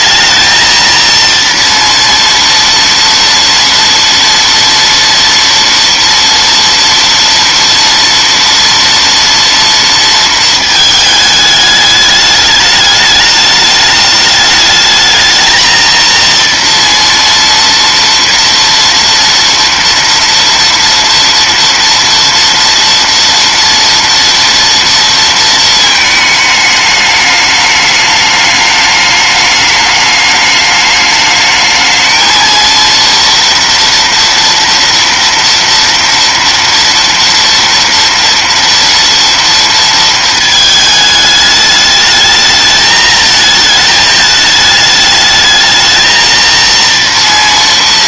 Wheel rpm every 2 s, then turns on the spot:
230, 230, 230, 230, 230, 210, 210, 220, 230, 230, 230, 230, 230, 210, 210, 210, 230, 230, 230, 240, 210, 220, 210, 230.
none